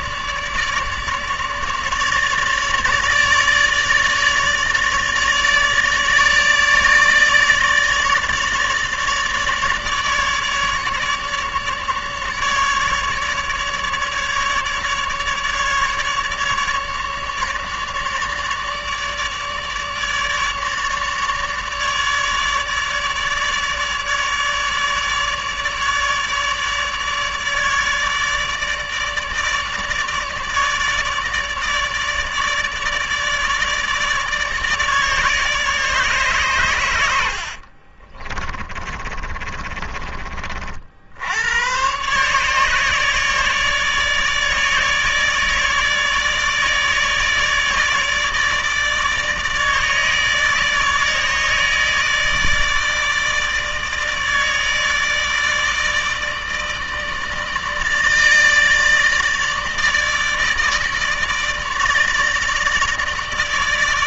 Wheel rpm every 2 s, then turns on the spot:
150, 150, 150, 150, 150, 150, 150, 150, 150, 150, 150, 150, 150, 150, 150, 150, 150, 150, 100, 30, 70, 150, 150, 150, 150, 150, 150, 160, 150, 160, 150, 150.
36-40